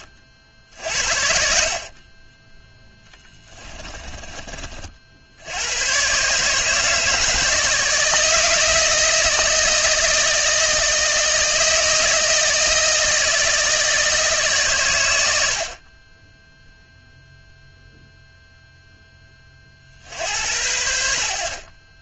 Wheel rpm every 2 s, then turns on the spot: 60, 10, 50, 150, 160, 160, 160, 110, 0, 10, 80.
2-4